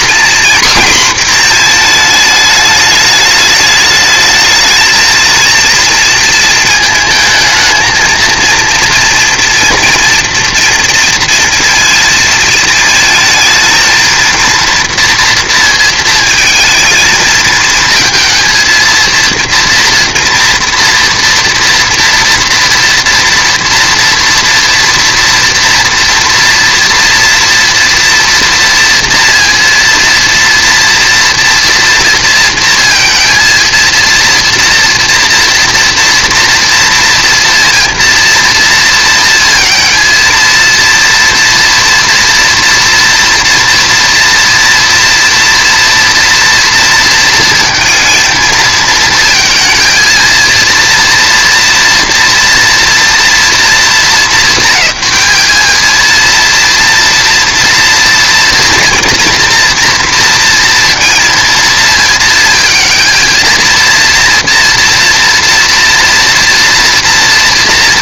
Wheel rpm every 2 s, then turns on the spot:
240, 210, 220, 220, 230, 230, 230, 240, 220, 230, 230, 230, 240, 230, 240, 230, 230, 240, 230, 230, 230, 230, 230, 230, 220, 230, 230, 200, 230, 230, 230, 220, 230, 240.
none